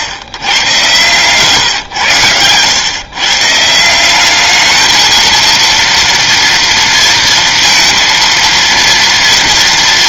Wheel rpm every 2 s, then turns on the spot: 110, 120, 220, 230, 230.
none